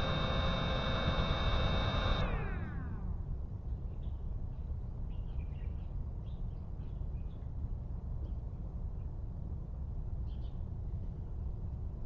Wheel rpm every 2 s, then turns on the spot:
0, 0, 0, 0, 0, 0.
none